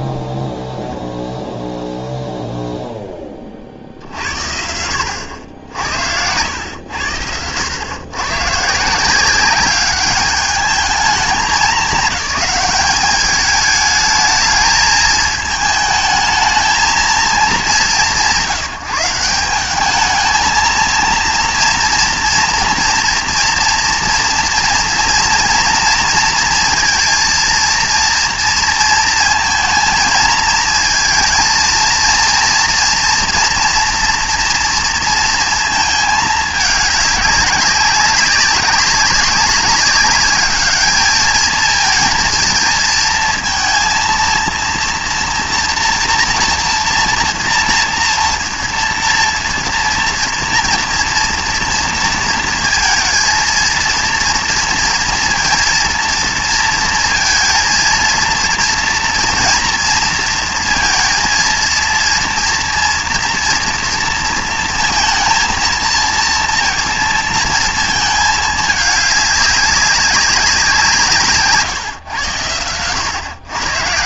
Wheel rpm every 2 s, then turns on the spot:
0, 0, 70, 90, 150, 210, 190, 220, 220, 160, 220, 230, 240, 230, 230, 220, 230, 240, 210, 200, 210, 230, 230, 240, 240, 230, 230, 230, 230, 230, 230, 230, 230, 230, 210, 190, 100.
none